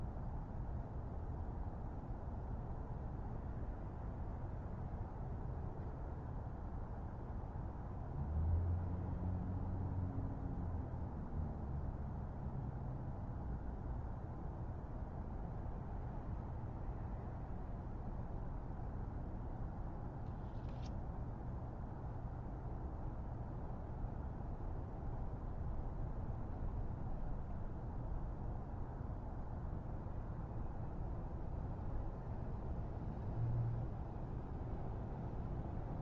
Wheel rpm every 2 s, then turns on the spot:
0, 0, 0, 0, 0, 0, 0, 0, 0, 0, 0, 0, 0, 0, 0, 0, 0, 0.
none